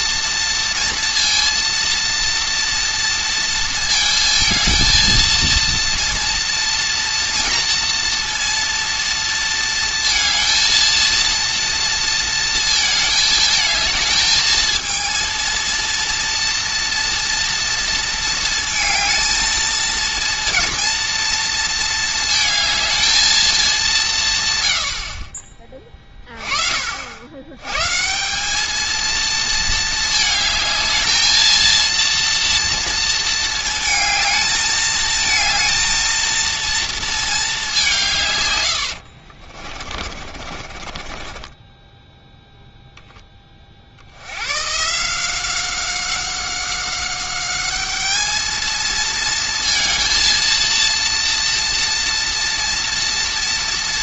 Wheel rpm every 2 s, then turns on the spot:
230, 230, 230, 230, 230, 230, 220, 220, 230, 220, 230, 220, 80, 60, 220, 220, 230, 220, 230, 80, 40, 0, 140, 190, 220, 230, 240.
38-42